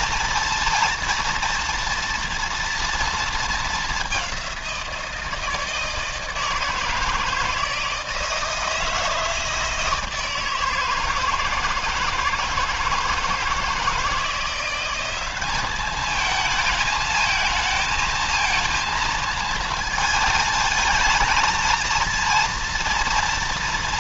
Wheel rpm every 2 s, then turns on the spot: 230, 230, 180, 160, 160, 160, 160, 180, 220, 220, 220, 230.
none